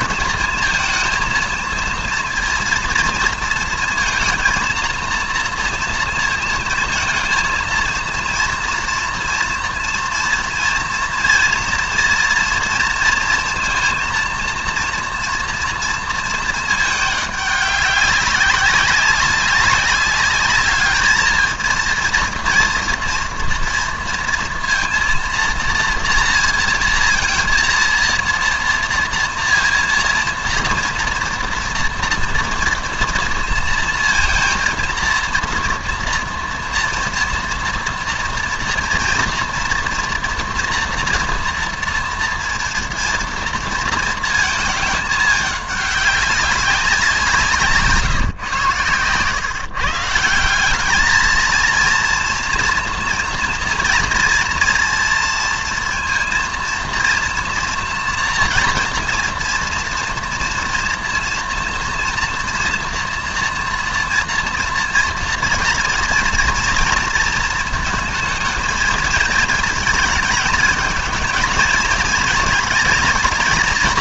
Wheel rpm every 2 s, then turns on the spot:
230, 230, 230, 230, 230, 230, 230, 230, 220, 190, 210, 230, 230, 230, 230, 230, 230, 230, 240, 230, 230, 230, 220, 200, 130, 200, 230, 230, 240, 230, 230, 230, 230, 230, 230, 230, 220.
none